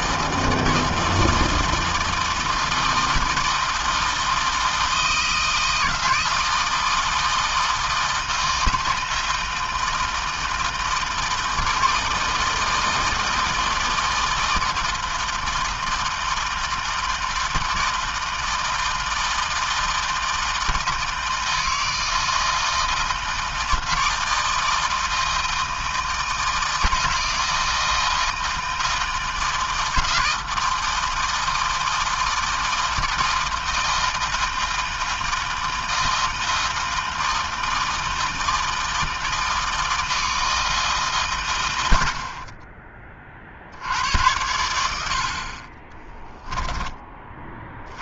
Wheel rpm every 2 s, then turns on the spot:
160, 160, 160, 160, 160, 160, 160, 160, 160, 160, 160, 160, 160, 160, 160, 160, 160, 160, 160, 160, 140, 30, 60, 30.
none